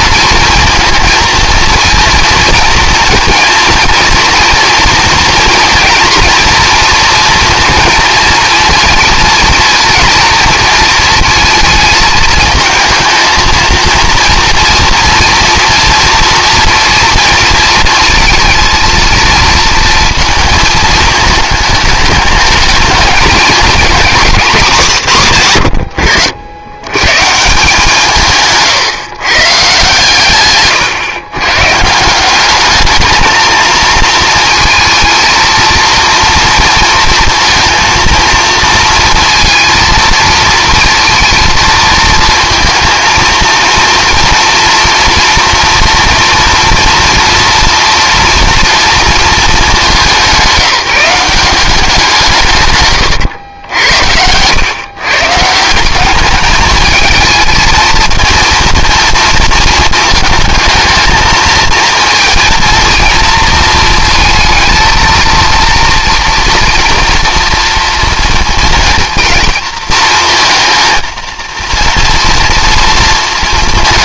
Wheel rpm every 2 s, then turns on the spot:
230, 230, 230, 230, 230, 230, 220, 230, 230, 230, 220, 220, 180, 90, 140, 130, 200, 220, 230, 230, 230, 230, 230, 230, 230, 190, 140, 120, 210, 220, 220, 230, 230, 230, 230, 230, 230.
none